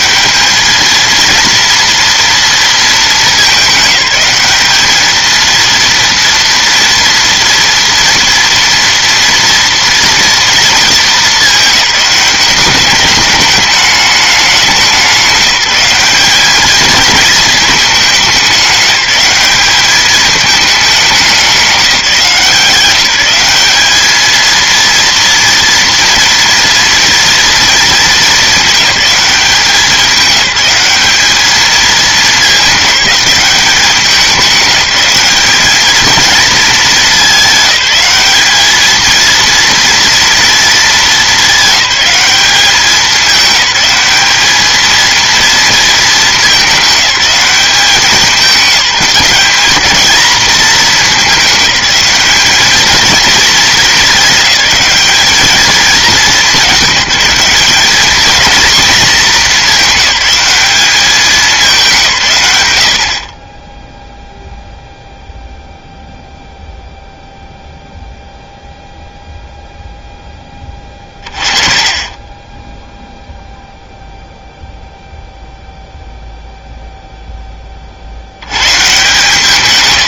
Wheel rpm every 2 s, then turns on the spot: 220, 230, 210, 230, 230, 230, 200, 200, 210, 190, 210, 170, 230, 230, 210, 210, 200, 190, 220, 210, 230, 200, 220, 210, 190, 210, 220, 210, 210, 230, 200, 80, 0, 0, 0, 20, 10, 0, 0, 120.
none